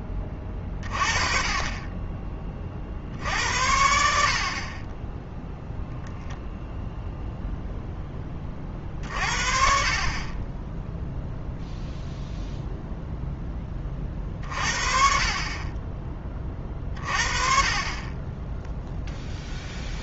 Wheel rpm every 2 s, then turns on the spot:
20, 40, 30, 0, 40, 10, 0, 40, 30, 0.
none